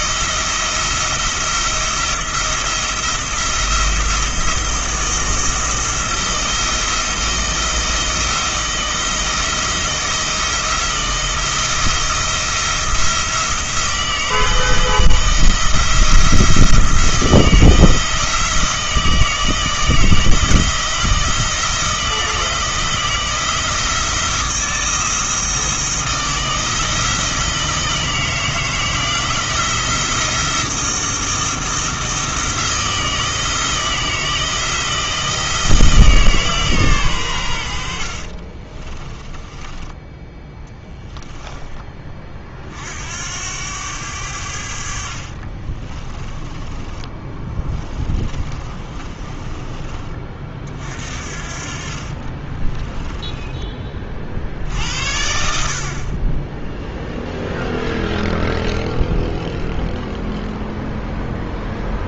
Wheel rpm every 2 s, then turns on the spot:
170, 170, 170, 170, 160, 160, 170, 170, 170, 160, 160, 160, 160, 160, 160, 170, 170, 170, 140, 30, 10, 50, 70, 20, 30, 50, 20, 70, 0, 0, 0.
38-42 46-50 52-54